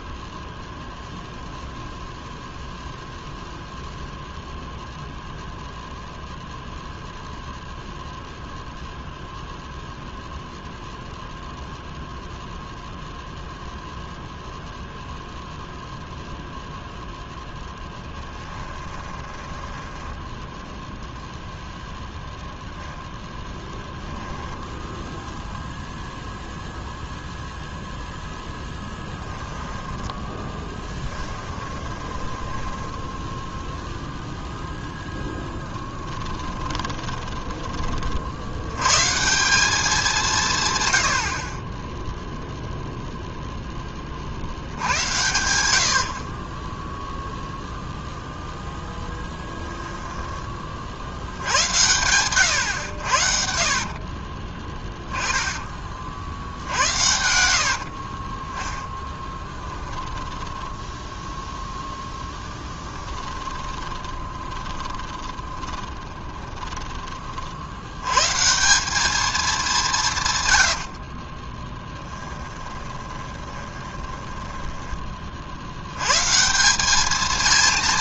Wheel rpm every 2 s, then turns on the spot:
0, 0, 0, 0, 0, 0, 0, 0, 0, 10, 10, 0, 10, 0, 0, 10, 10, 0, 20, 80, 150, 0, 60, 30, 0, 30, 100, 40, 70, 20, 10, 10, 20, 20, 150, 110, 20, 10, 160.
18-20 24-26 30-34 36-38 54-56 58-68 72-76